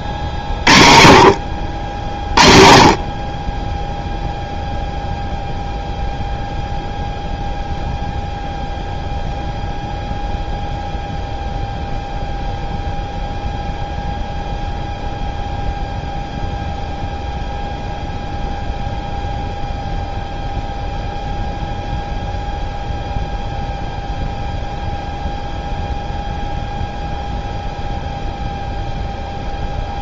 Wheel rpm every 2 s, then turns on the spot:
60, 40, 0, 0, 0, 0, 0, 0, 0, 0, 0, 0, 0, 0, 0.
none